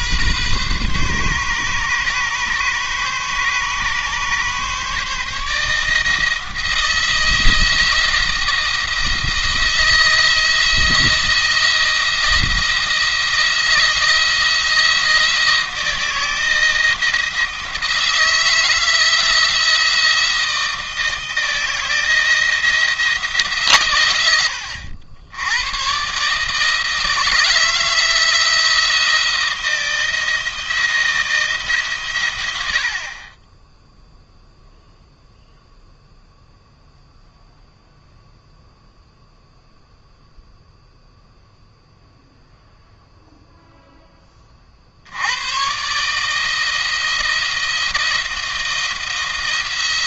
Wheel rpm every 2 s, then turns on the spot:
130, 140, 140, 160, 170, 160, 170, 170, 160, 160, 160, 170, 80, 150, 160, 170, 70, 0, 0, 0, 0, 0, 50, 160, 170.
none